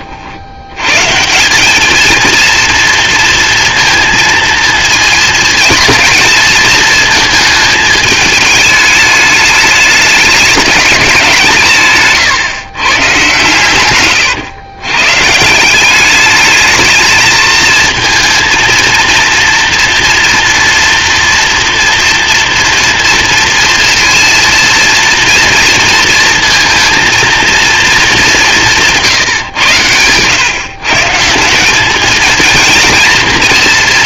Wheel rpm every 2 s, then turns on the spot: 160, 230, 220, 220, 210, 180, 120, 140, 220, 230, 230, 230, 230, 230, 150, 180, 230.
none